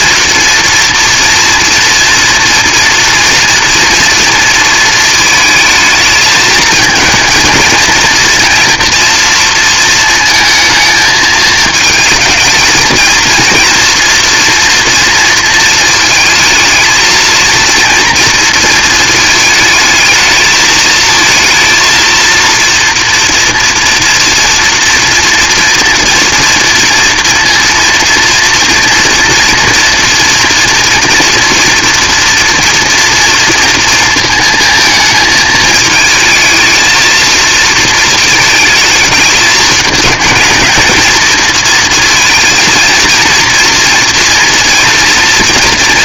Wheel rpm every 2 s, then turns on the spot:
230, 230, 230, 220, 240, 220, 220, 230, 220, 230, 230, 230, 230, 240, 230, 240, 230, 220, 220, 210, 220, 230, 240.
none